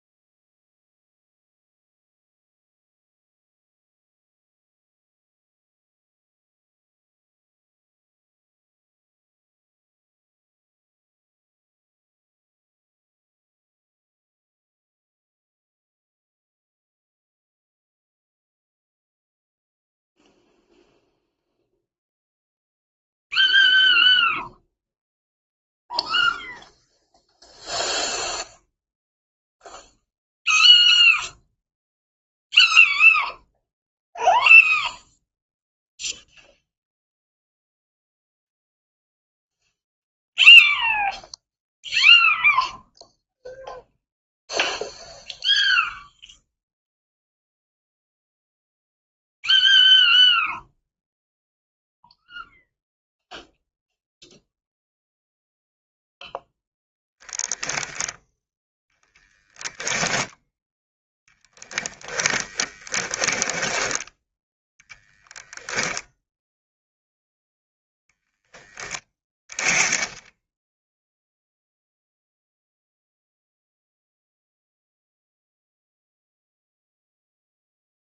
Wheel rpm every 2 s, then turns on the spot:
0, 0, 0, 0, 0, 0, 0, 0, 0, 0, 0, 0, 0, 0, 0, 0, 0, 0, 0, 0, 0, 0, 0, 0, 0, 0, 0, 0, 0, 10, 0, 10, 0, 0, 10, 10, 0, 0, 0.
62-64